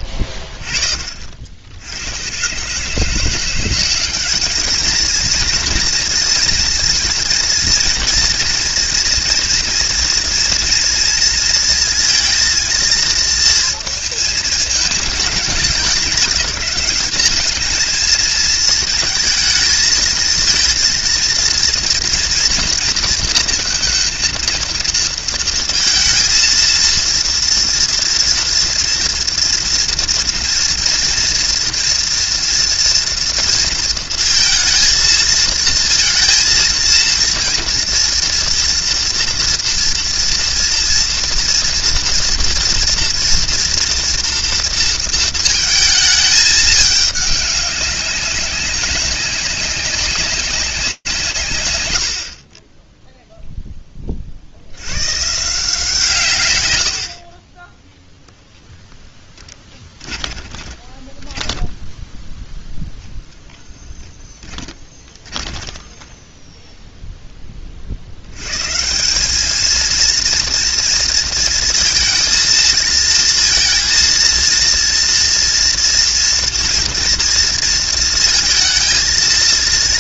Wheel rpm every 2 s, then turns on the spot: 50, 160, 220, 230, 230, 230, 230, 210, 200, 220, 230, 230, 220, 230, 230, 230, 240, 230, 230, 230, 230, 230, 230, 210, 190, 180, 10, 100, 90, 10, 10, 0, 20, 10, 200, 230, 230, 230, 230, 230.
58-62 64-66